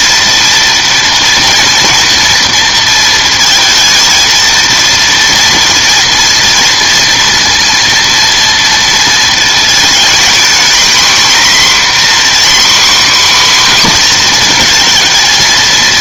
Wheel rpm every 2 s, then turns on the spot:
230, 230, 230, 230, 230, 240, 260, 240.
none